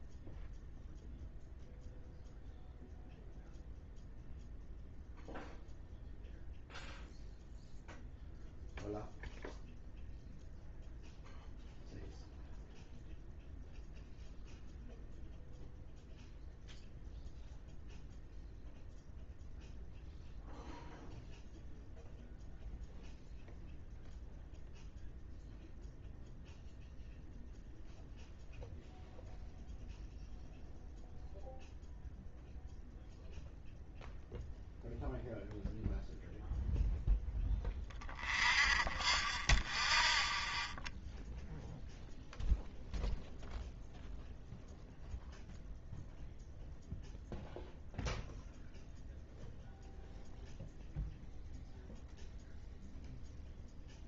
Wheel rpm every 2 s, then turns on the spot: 0, 0, 0, 0, 0, 0, 0, 0, 0, 0, 0, 0, 0, 0, 0, 0, 0, 0, 0, 0, 0, 0, 0, 0, 0, 0, 0.
none